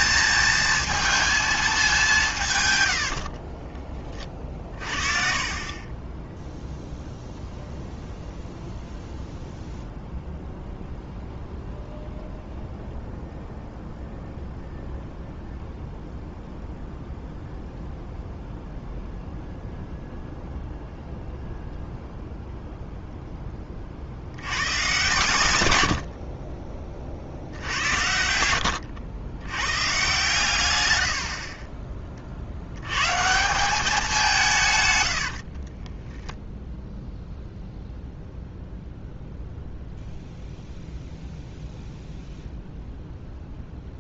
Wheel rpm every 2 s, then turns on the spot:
230, 120, 40, 0, 0, 0, 0, 0, 0, 0, 0, 0, 110, 30, 90, 100, 90, 140, 0, 0, 0, 0.
4-6 28-30